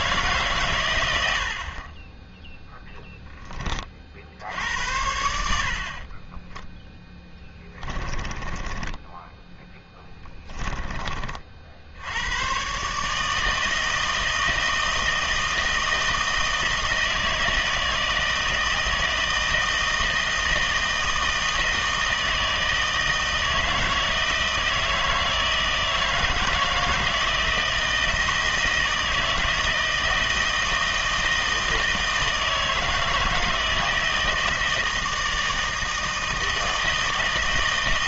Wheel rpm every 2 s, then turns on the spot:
130, 10, 80, 10, 20, 20, 130, 160, 160, 160, 160, 160, 160, 160, 160, 160, 160, 160, 160.
6-12